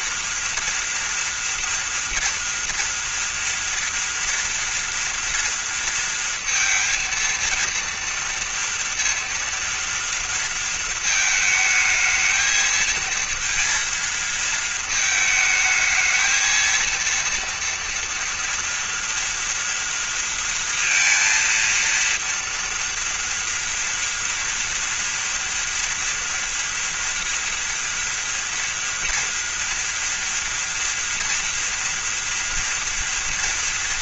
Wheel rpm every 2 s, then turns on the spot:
230, 230, 230, 230, 230, 220, 230, 220, 230, 230, 230, 230, 230, 240, 240, 230, 240.
none